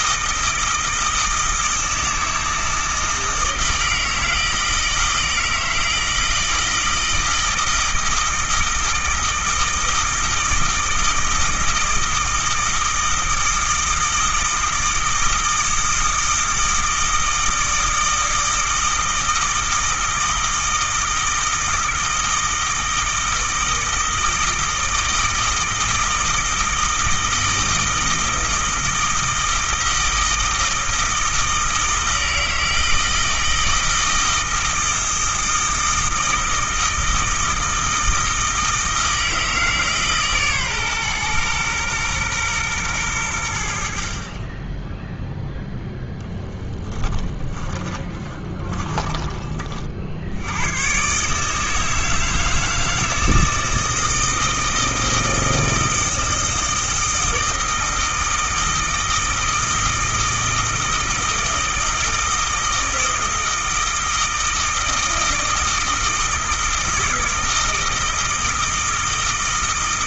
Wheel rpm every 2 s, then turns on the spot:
160, 160, 160, 160, 160, 160, 160, 160, 160, 160, 160, 160, 160, 160, 160, 160, 160, 160, 160, 160, 130, 110, 10, 10, 20, 120, 160, 160, 160, 160, 160, 160, 160, 160, 160.
46-50